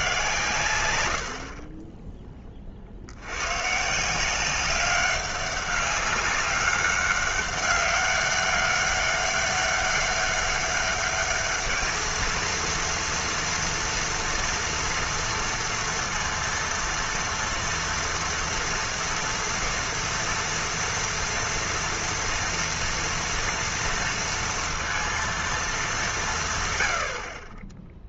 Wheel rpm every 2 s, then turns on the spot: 120, 30, 190, 200, 200, 200, 230, 230, 230, 240, 230, 240, 230, 190.
none